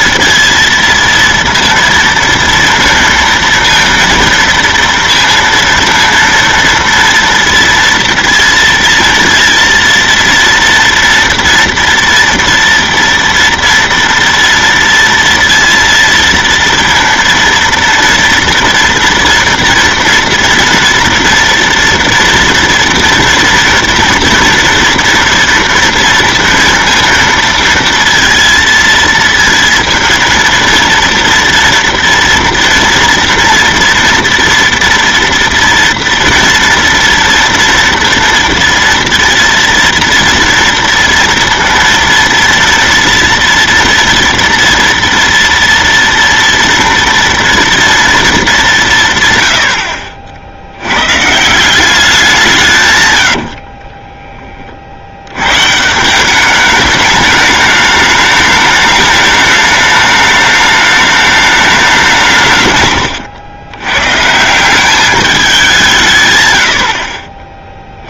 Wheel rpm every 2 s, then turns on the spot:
230, 230, 230, 230, 230, 230, 230, 230, 230, 240, 230, 230, 230, 230, 230, 230, 230, 230, 240, 230, 230, 230, 230, 230, 200, 70, 170, 20, 200, 210, 210, 160, 170, 100.
none